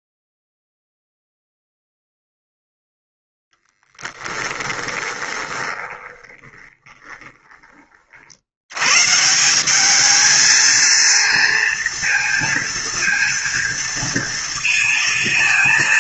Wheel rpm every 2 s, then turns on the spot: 0, 0, 20, 20, 80, 220, 230, 230.
4-8